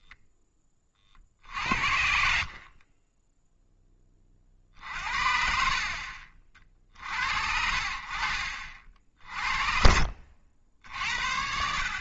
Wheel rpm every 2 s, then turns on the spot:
30, 30, 50, 50, 50, 60.
none